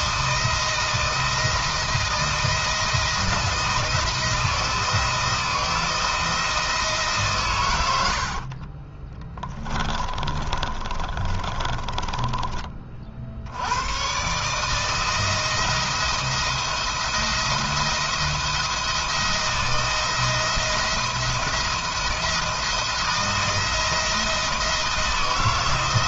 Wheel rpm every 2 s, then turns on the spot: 170, 170, 160, 160, 30, 30, 40, 160, 170, 170, 170, 170, 160.
8-12